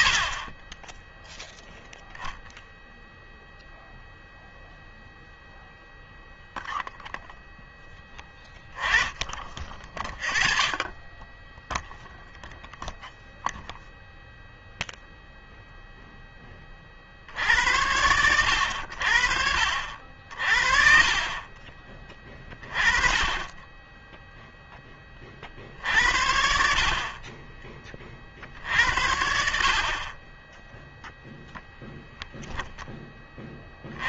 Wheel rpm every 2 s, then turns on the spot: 40, 0, 0, 0, 10, 30, 0, 0, 20, 80, 50, 30, 10, 70, 60, 20, 0.
26-28